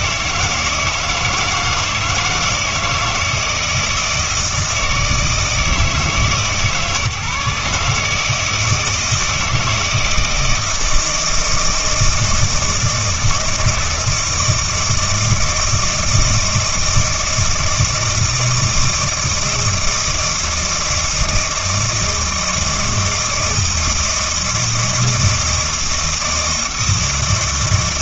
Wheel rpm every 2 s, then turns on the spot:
160, 160, 160, 140, 160, 160, 160, 160, 160, 160, 160, 160, 160, 160.
none